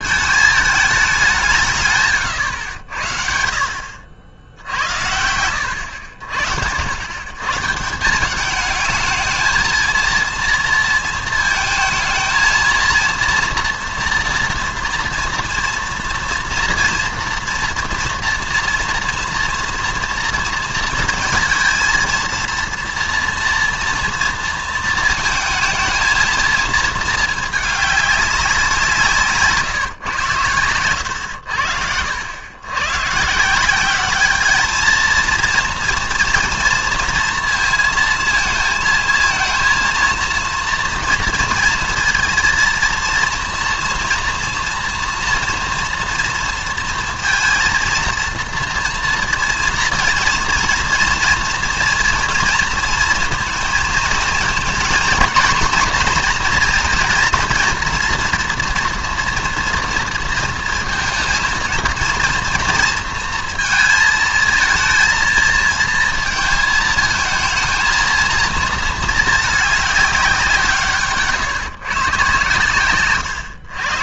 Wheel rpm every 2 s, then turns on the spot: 210, 90, 80, 80, 210, 230, 230, 240, 230, 230, 230, 230, 230, 230, 180, 100, 100, 220, 230, 220, 230, 230, 230, 230, 230, 230, 230, 230, 230, 230, 230, 230, 230, 220, 230, 160, 120.
30-32